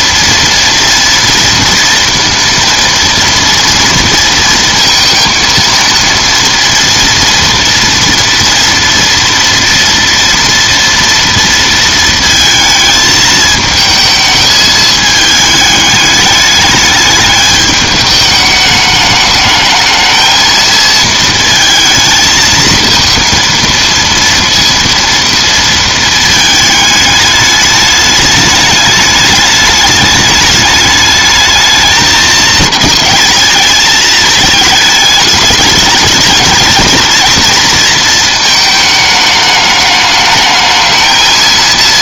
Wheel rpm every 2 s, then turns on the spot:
230, 230, 230, 230, 230, 230, 220, 220, 210, 210, 220, 220, 230, 220, 210, 210, 220, 220, 220, 220, 210.
none